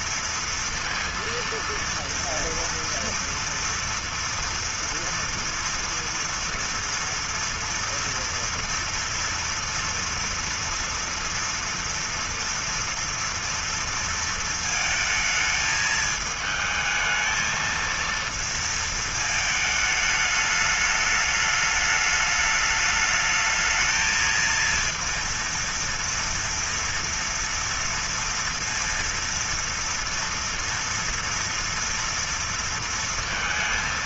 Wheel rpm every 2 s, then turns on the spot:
230, 230, 230, 240, 230, 230, 230, 220, 220, 230, 210, 210, 230, 230, 230, 230, 230.
none